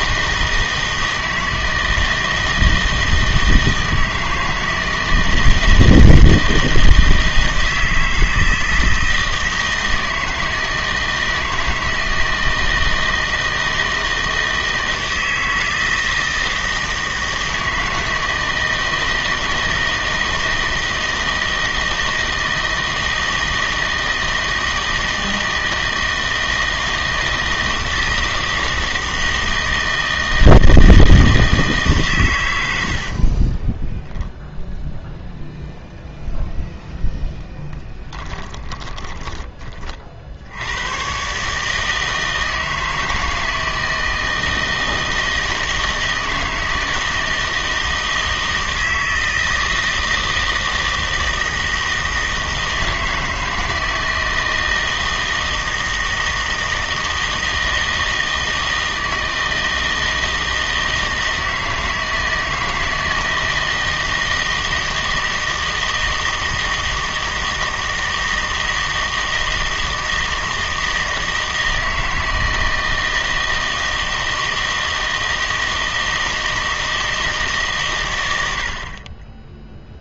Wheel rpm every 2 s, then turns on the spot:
160, 160, 160, 160, 160, 160, 160, 160, 160, 160, 160, 160, 160, 160, 160, 160, 80, 0, 0, 20, 90, 160, 160, 160, 160, 160, 160, 160, 160, 160, 160, 160, 160, 160, 160, 160, 160, 160, 160, 80.
38-40